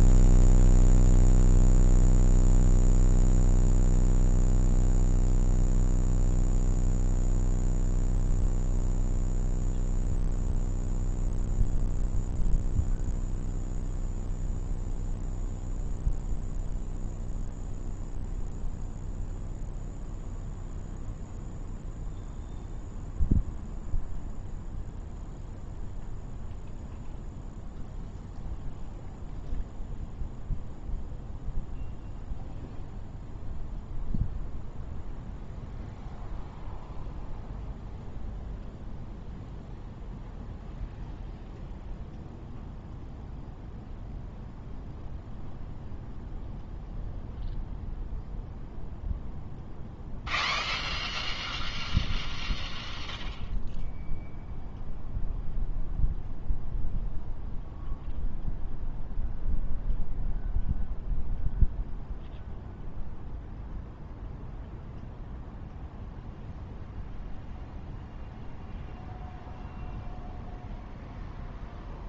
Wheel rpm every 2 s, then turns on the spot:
0, 0, 0, 0, 0, 0, 0, 0, 0, 0, 0, 0, 0, 0, 0, 0, 0, 0, 0, 0, 0, 0, 0, 0, 0, 0, 0, 0, 0, 0, 0, 0, 0, 0, 0, 0.
none